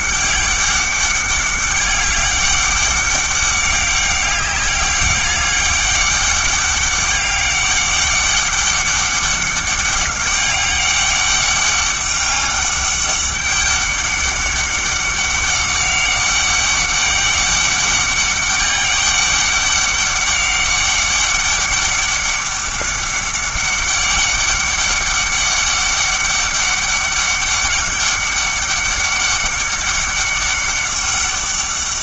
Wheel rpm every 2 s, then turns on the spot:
200, 200, 200, 200, 200, 200, 200, 200, 200, 200, 200, 200, 200, 200, 200, 200.
none